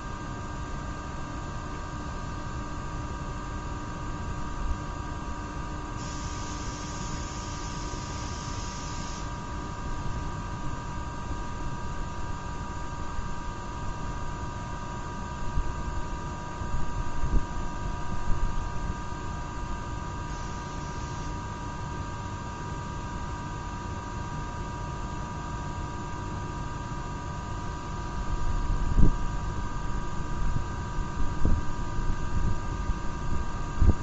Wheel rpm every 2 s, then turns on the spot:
0, 0, 0, 0, 0, 0, 0, 0, 0, 0, 0, 0, 0, 0, 0, 0, 0.
none